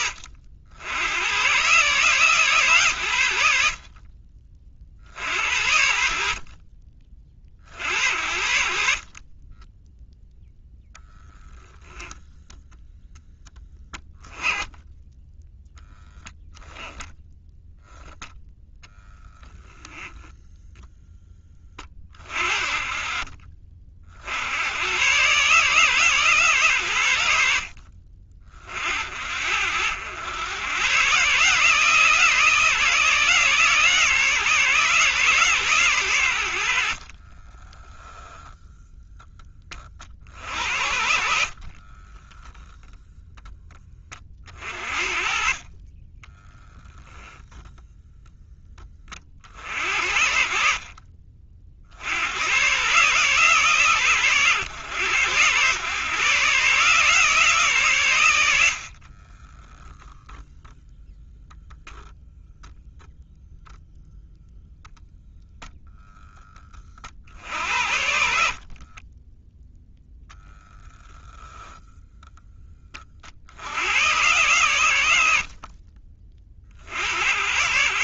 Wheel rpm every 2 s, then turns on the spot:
90, 110, 60, 30, 40, 0, 0, 10, 10, 0, 10, 40, 120, 100, 60, 130, 160, 140, 50, 0, 70, 10, 50, 0, 40, 40, 140, 110, 150, 50, 0, 0, 0, 40, 30, 0, 40, 90, 70.
36-38 40-42 58-60 68-70